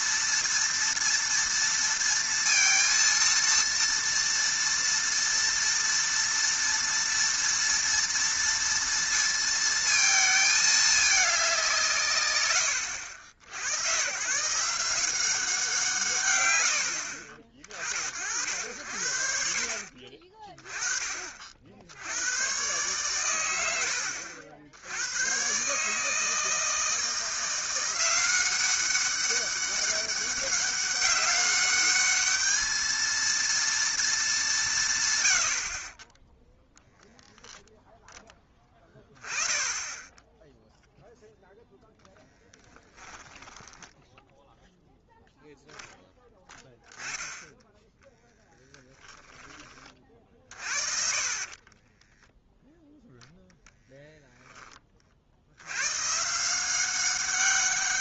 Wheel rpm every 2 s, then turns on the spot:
230, 230, 230, 230, 230, 220, 100, 160, 90, 70, 30, 120, 80, 160, 190, 200, 220, 170, 0, 10, 0, 10, 0, 10, 10, 40, 0, 20, 180.
42-44 48-50